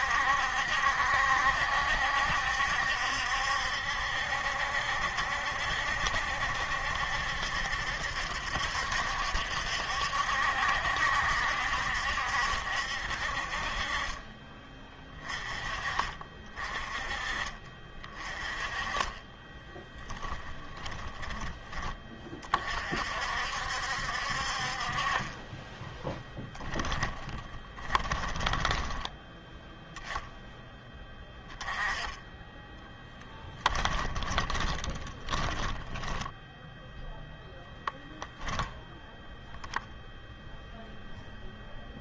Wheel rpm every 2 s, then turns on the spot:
70, 70, 70, 70, 70, 70, 60, 30, 30, 30, 20, 50, 50, 10, 20, 20, 10, 30, 10, 0, 0.
20-22 28-30 34-36